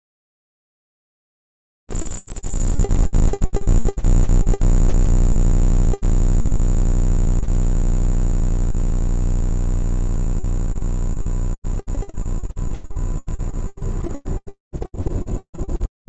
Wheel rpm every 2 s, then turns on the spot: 0, 0, 0, 0, 0, 0, 0, 0.
none